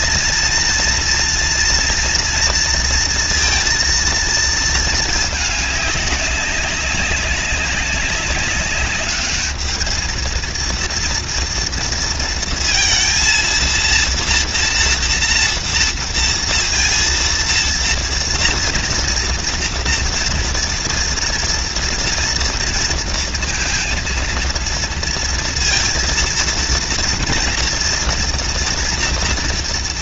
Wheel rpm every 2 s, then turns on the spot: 230, 230, 230, 200, 200, 230, 230, 230, 230, 230, 230, 230, 230, 230, 230.
none